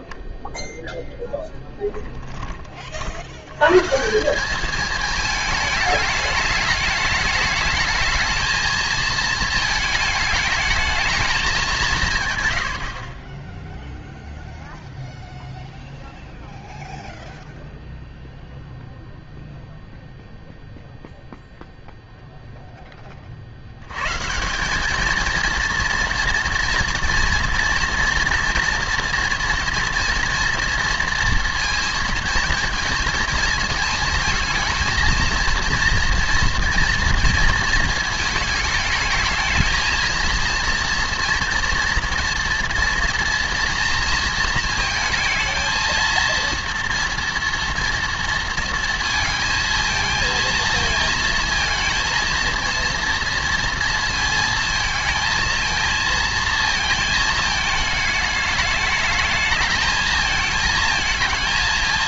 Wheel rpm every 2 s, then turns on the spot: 10, 40, 210, 210, 220, 220, 90, 0, 0, 0, 0, 10, 190, 230, 240, 230, 230, 220, 240, 220, 230, 230, 220, 230, 230, 230, 230, 230, 220, 210, 220.
none